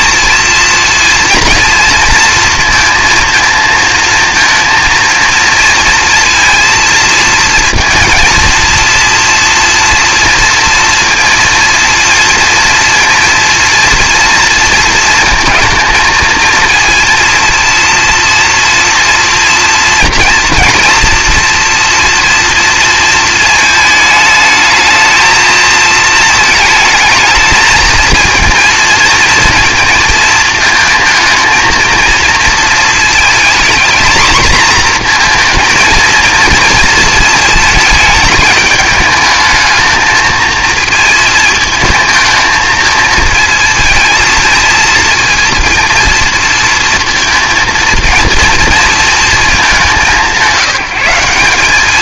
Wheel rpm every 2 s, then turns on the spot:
230, 230, 230, 230, 230, 230, 230, 230, 230, 230, 230, 230, 220, 220, 230, 220, 220, 230, 230, 210, 230, 220, 230, 230, 230, 190.
none